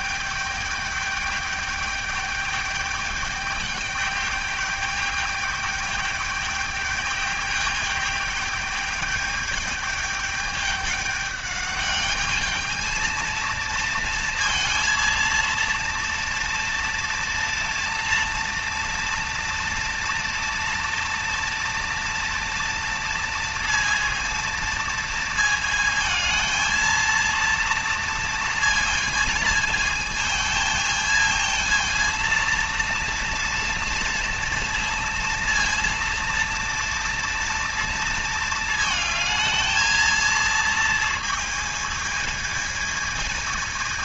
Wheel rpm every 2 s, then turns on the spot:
210, 210, 210, 210, 210, 210, 220, 230, 230, 230, 240, 230, 230, 230, 230, 220, 230, 230, 230, 220, 230, 220.
none